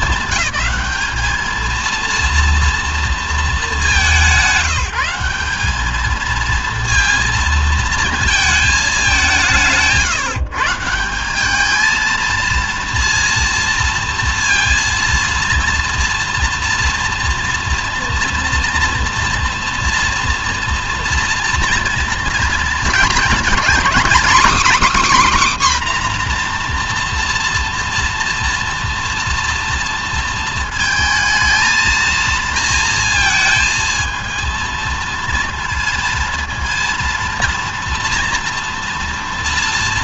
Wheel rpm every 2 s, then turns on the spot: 220, 230, 180, 230, 210, 170, 230, 230, 230, 230, 230, 230, 280, 240, 230, 230, 230, 230, 230, 240.
none